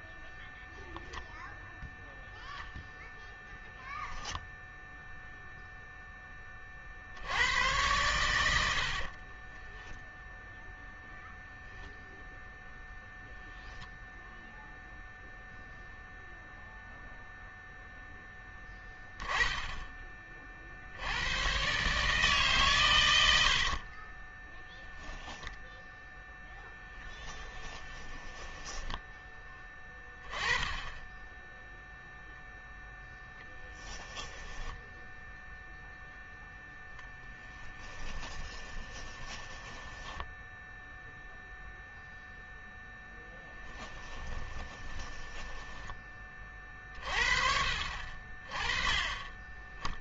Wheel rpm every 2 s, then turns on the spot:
0, 0, 0, 40, 70, 0, 0, 0, 0, 20, 70, 120, 0, 0, 10, 20, 0, 10, 0, 20, 0, 0, 20, 30, 20.
28-30 34-36 38-40 44-46